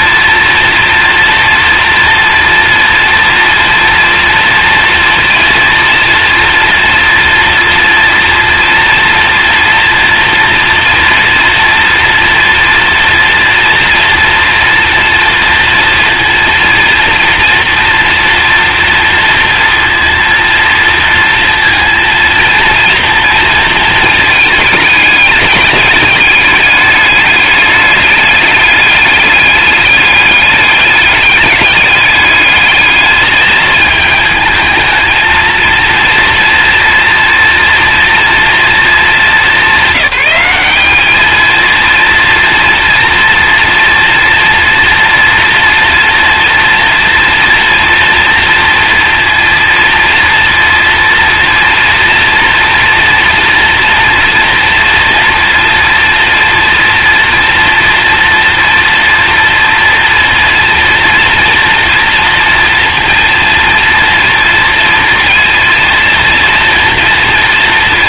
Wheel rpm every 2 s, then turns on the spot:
230, 230, 230, 230, 240, 230, 240, 230, 230, 230, 230, 230, 220, 210, 200, 210, 210, 220, 230, 230, 200, 230, 240, 230, 230, 230, 230, 230, 230, 230, 230, 240, 230, 230.
none